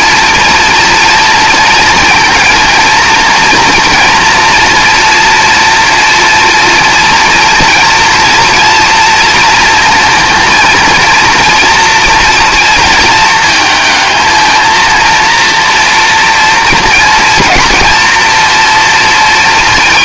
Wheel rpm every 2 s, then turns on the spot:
240, 230, 230, 230, 230, 230, 230, 230, 230, 230.
none